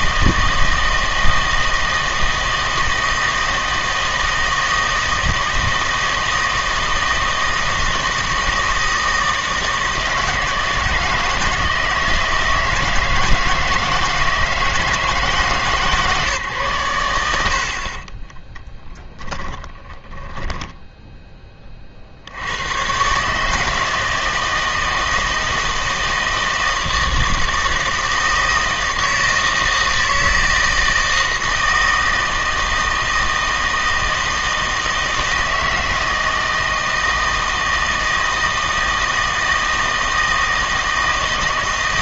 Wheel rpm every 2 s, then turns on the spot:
160, 160, 160, 160, 160, 160, 160, 160, 120, 10, 10, 110, 160, 160, 160, 160, 160, 160, 160, 160, 160.
18-22